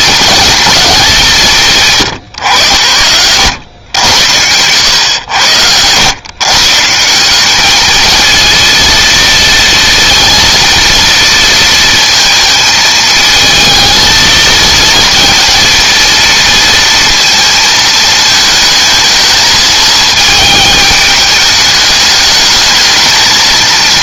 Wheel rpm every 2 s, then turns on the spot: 220, 100, 100, 160, 230, 230, 220, 230, 230, 220, 210, 220.
none